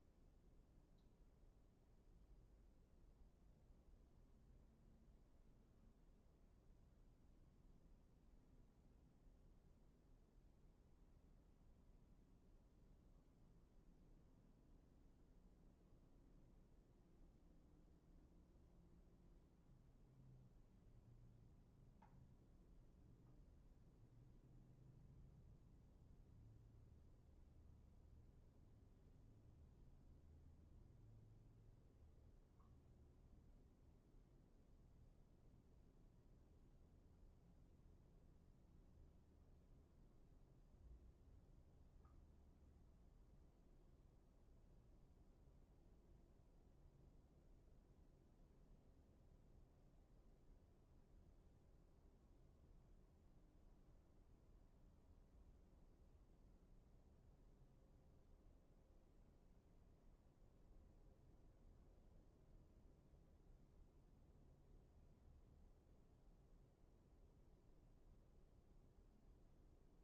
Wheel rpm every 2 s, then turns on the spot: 0, 0, 0, 0, 0, 0, 0, 0, 0, 0, 0, 0, 0, 0, 0, 0, 0, 0, 0, 0, 0, 0, 0, 0, 0, 0, 0, 0, 0, 0, 0, 0, 0, 0, 0.
none